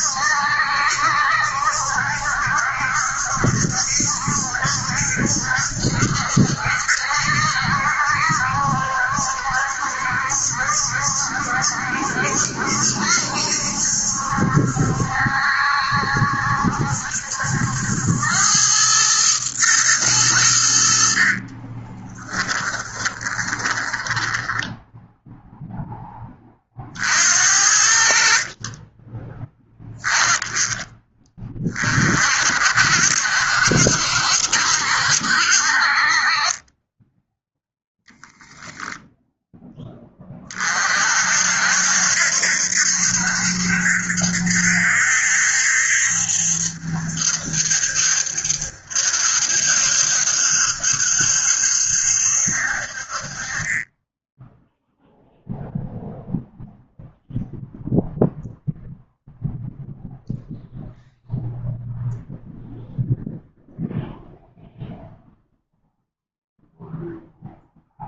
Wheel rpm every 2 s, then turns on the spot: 70, 60, 70, 70, 70, 70, 70, 70, 70, 110, 70, 20, 10, 50, 20, 20, 60, 70, 20, 0, 50, 70, 70, 70, 70, 70, 50, 0, 0, 0, 0, 0, 0, 0.
22-26